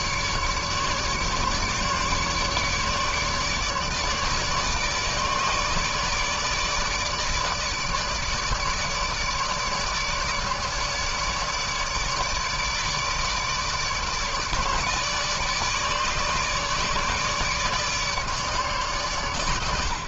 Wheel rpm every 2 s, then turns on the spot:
150, 150, 150, 150, 150, 150, 150, 150, 150, 140.
none